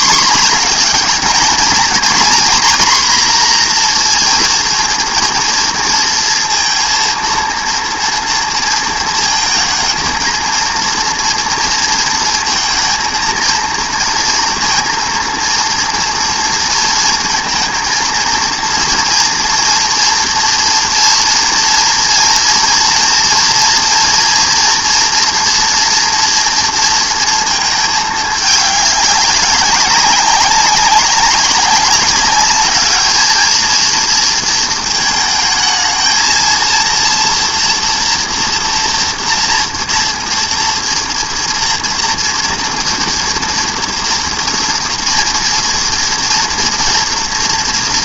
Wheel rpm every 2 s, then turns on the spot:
210, 240, 230, 230, 230, 230, 220, 230, 230, 230, 230, 230, 230, 230, 200, 200, 210, 230, 230, 230, 230, 230, 230, 230.
none